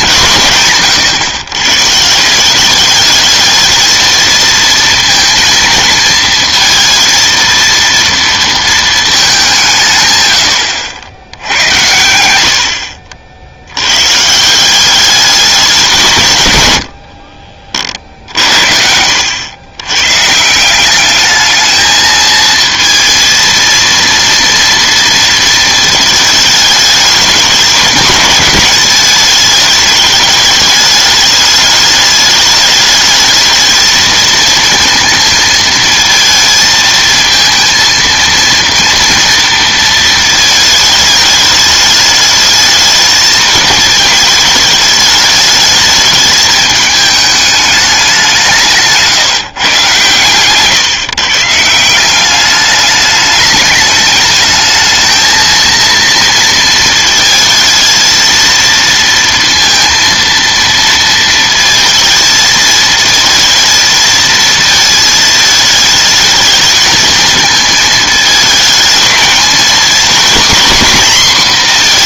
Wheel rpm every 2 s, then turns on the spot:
140, 200, 230, 230, 220, 80, 70, 180, 110, 60, 180, 230, 230, 210, 210, 210, 210, 230, 220, 230, 220, 220, 210, 210, 170, 140, 200, 220, 220, 230, 230, 220, 220, 220, 220, 250.
none